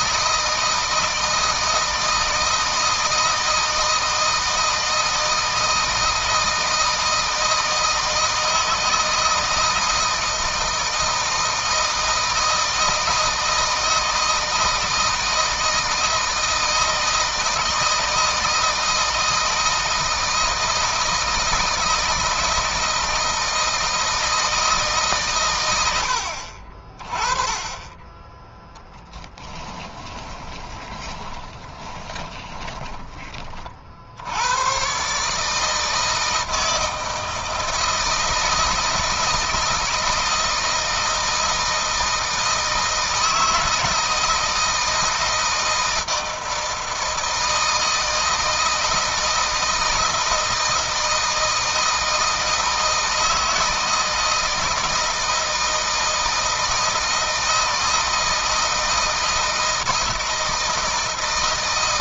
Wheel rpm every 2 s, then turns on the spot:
160, 160, 160, 160, 160, 160, 160, 160, 160, 160, 160, 160, 160, 50, 0, 20, 20, 110, 160, 160, 160, 160, 160, 160, 160, 160, 160, 160, 160, 160, 160.
30-34